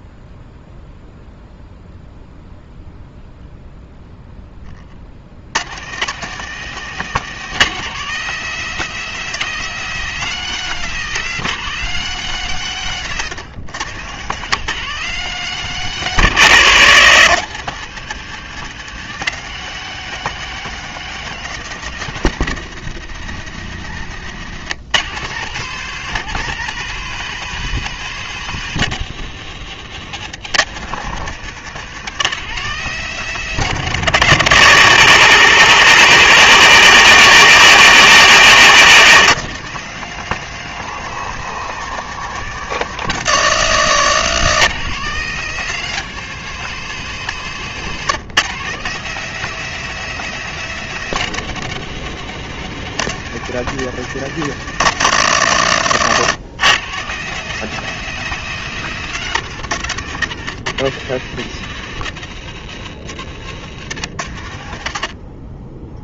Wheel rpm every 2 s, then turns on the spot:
0, 0, 70, 170, 180, 170, 140, 170, 140, 180, 170, 120, 140, 180, 140, 160, 160, 110, 110, 140, 170, 140, 170, 170, 170, 160, 160, 120, 160, 160, 110, 80, 40.
12-14 62-64